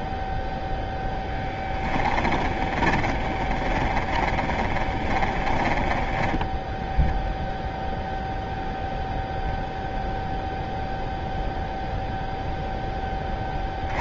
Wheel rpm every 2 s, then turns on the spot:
0, 20, 10, 0, 0, 0, 40.
2-6